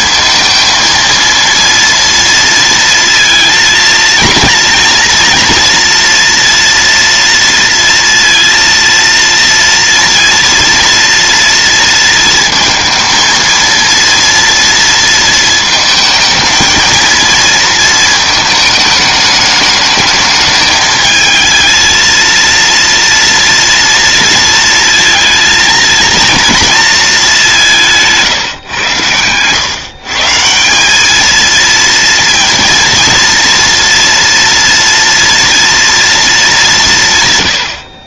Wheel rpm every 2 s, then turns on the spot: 230, 230, 230, 230, 230, 230, 230, 230, 220, 220, 220, 230, 230, 230, 140, 170, 230, 240, 200.
none